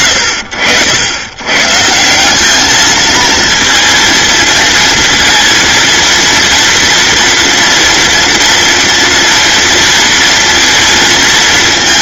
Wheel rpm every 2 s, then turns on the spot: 70, 220, 220, 230, 230, 230.
none